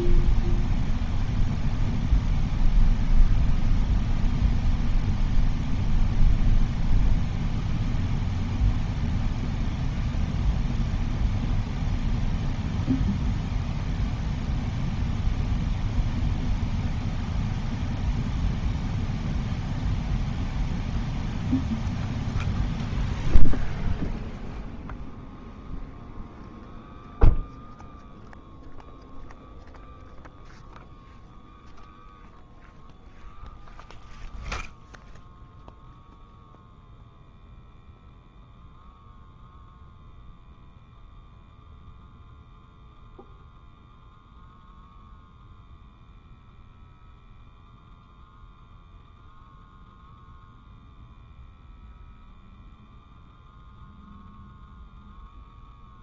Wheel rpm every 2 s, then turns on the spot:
0, 0, 0, 0, 0, 0, 0, 0, 0, 0, 0, 0, 0, 0, 0, 0, 0, 0, 0, 0, 0, 0, 0, 0, 0, 0, 0, 0.
none